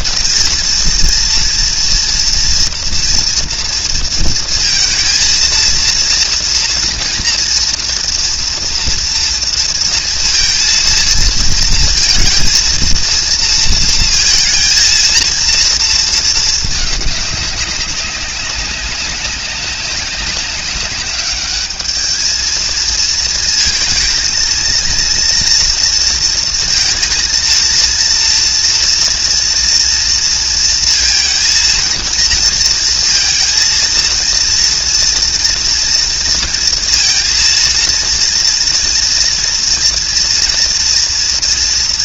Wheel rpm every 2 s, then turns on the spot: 230, 230, 220, 230, 230, 230, 230, 230, 220, 190, 190, 220, 230, 230, 230, 230, 230, 230, 230, 230, 230.
none